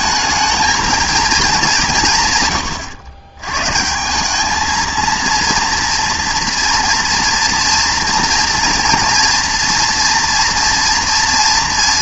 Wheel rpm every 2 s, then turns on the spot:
220, 130, 210, 230, 240, 230.
none